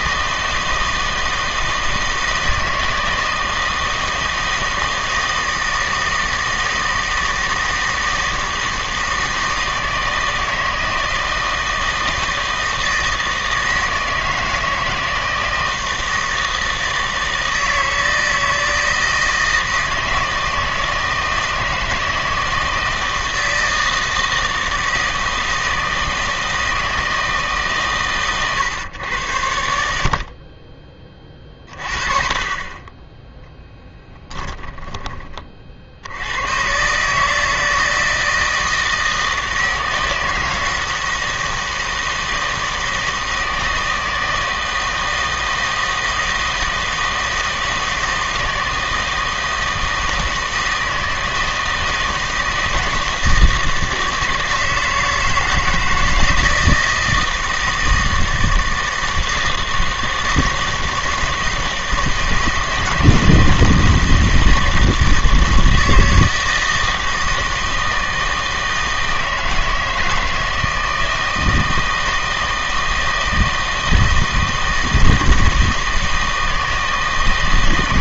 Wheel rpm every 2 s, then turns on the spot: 160, 160, 160, 160, 160, 160, 160, 160, 160, 160, 160, 160, 160, 160, 120, 30, 30, 10, 130, 160, 160, 160, 160, 160, 160, 160, 160, 160, 160, 160, 160, 160, 160, 160, 160, 160, 160, 160, 160.
none